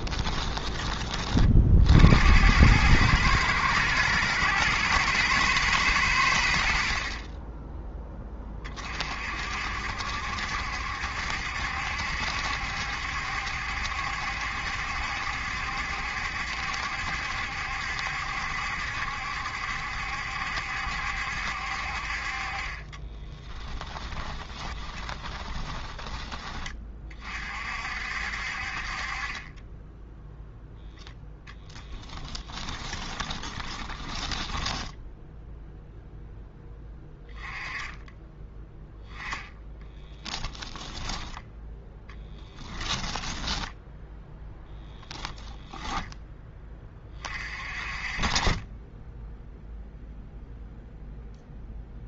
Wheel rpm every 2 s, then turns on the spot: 20, 110, 120, 50, 30, 70, 70, 70, 70, 70, 70, 30, 20, 30, 40, 0, 20, 10, 10, 10, 10, 10, 0, 20, 20, 0.
22-26 32-36 40-44